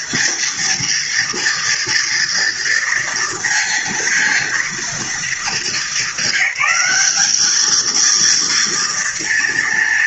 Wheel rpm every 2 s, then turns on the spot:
230, 230, 230, 200, 230.
none